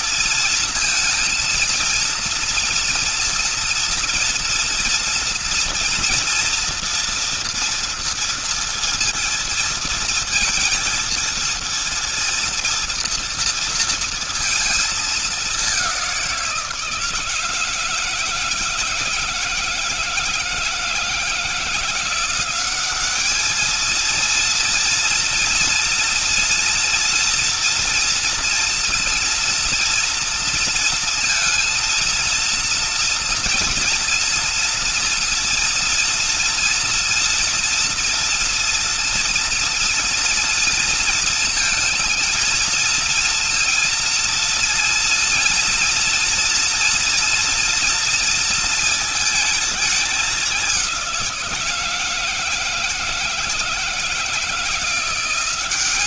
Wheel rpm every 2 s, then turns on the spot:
230, 230, 230, 230, 230, 230, 230, 230, 180, 160, 160, 180, 230, 240, 240, 230, 230, 230, 230, 240, 230, 230, 230, 240, 230, 200, 160, 160.
none